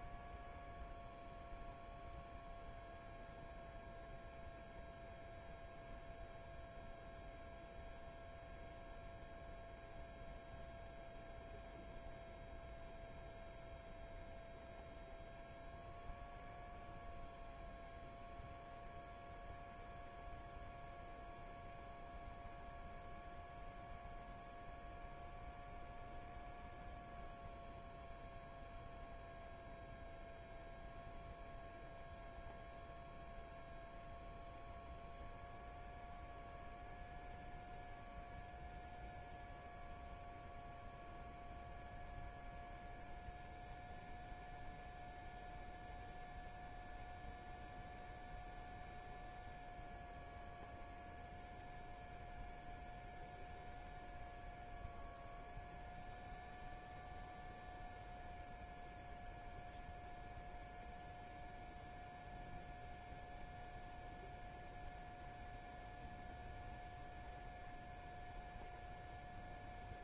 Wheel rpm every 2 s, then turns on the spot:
0, 0, 0, 0, 0, 0, 0, 0, 0, 0, 0, 0, 0, 0, 0, 0, 0, 0, 0, 0, 0, 0, 0, 0, 0, 0, 0, 0, 0, 0, 0, 0, 0, 0, 0.
none